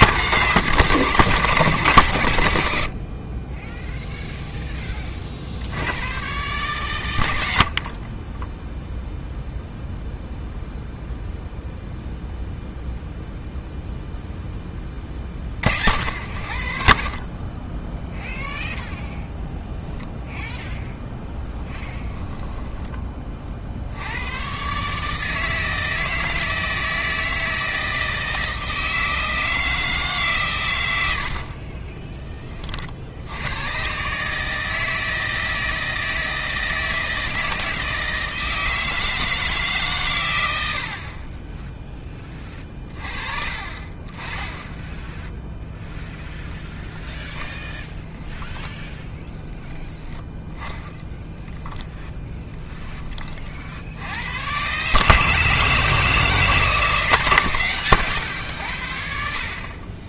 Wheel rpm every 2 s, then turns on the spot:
160, 70, 10, 120, 10, 0, 0, 10, 60, 0, 0, 10, 130, 160, 160, 120, 40, 160, 160, 160, 80, 30, 10, 0, 10, 10, 10, 120, 160, 90.
none